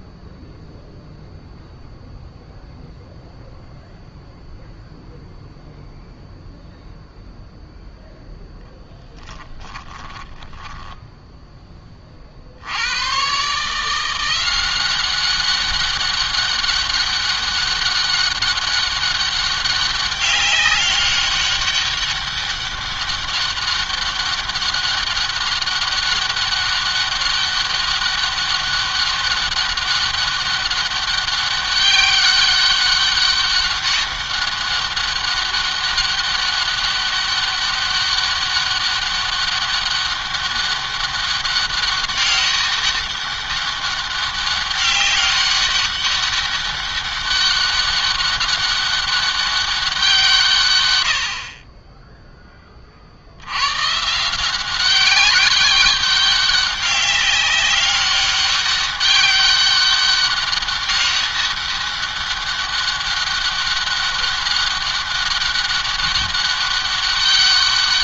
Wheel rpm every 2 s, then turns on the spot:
0, 0, 0, 0, 10, 10, 70, 180, 200, 200, 200, 200, 200, 200, 200, 200, 200, 200, 200, 200, 200, 200, 190, 200, 200, 120, 30, 180, 200, 200, 200, 200, 200, 200.
8-12